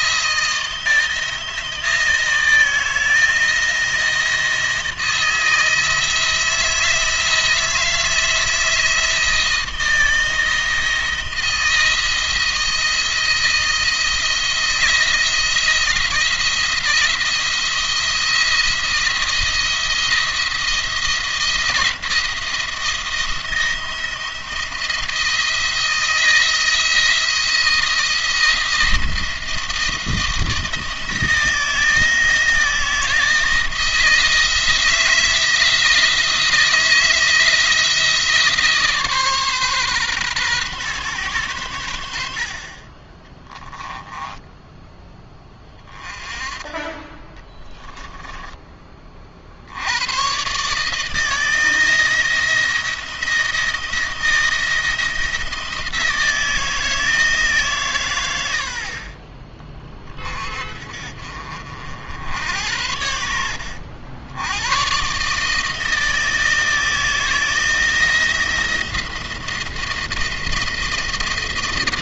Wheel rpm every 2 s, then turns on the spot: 160, 160, 160, 160, 160, 160, 170, 160, 170, 170, 170, 170, 170, 160, 170, 160, 160, 160, 160, 150, 130, 50, 10, 30, 20, 150, 170, 160, 160, 70, 40, 90, 120, 160, 170, 160.
none